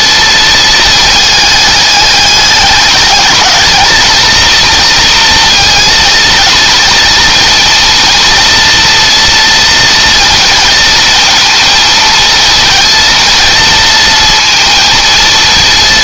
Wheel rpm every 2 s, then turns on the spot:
220, 210, 230, 230, 230, 230, 230, 230.
none